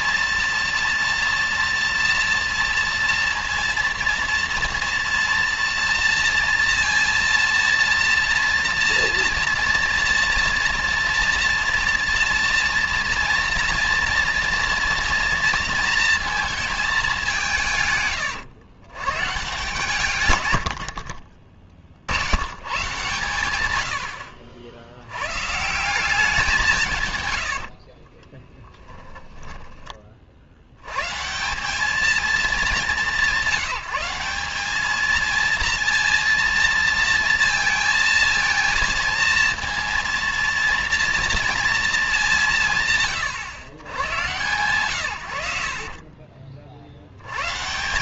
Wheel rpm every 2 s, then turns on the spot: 230, 230, 230, 230, 240, 230, 230, 230, 220, 100, 100, 100, 60, 190, 20, 50, 220, 190, 230, 230, 230, 190, 120, 50.
28-30